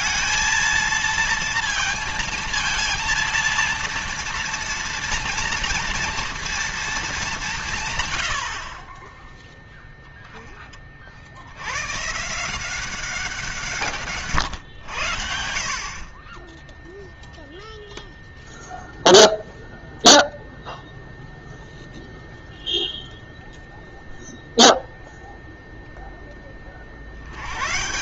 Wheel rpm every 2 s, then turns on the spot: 230, 230, 230, 230, 80, 20, 170, 120, 10, 0, 0, 0, 0, 30.
none